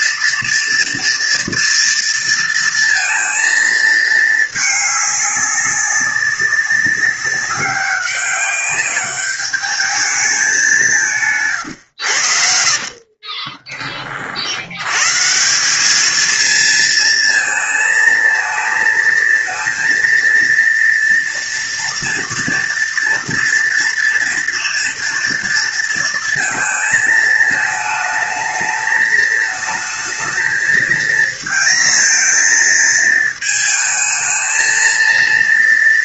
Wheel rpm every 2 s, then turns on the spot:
240, 230, 210, 200, 200, 190, 60, 90, 230, 220, 230, 230, 230, 220, 220, 220, 230, 220.
12-14